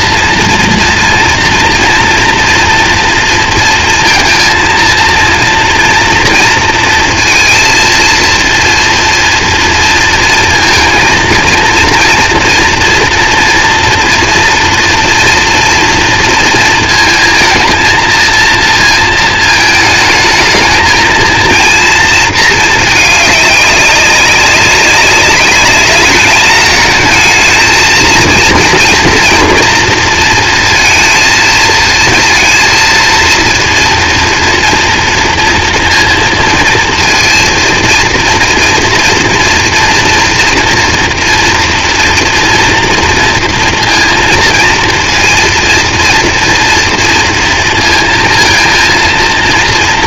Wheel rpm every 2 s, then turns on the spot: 230, 230, 230, 230, 240, 230, 240, 230, 230, 230, 220, 220, 190, 220, 230, 230, 230, 230, 230, 230, 230, 230, 230, 230, 230.
none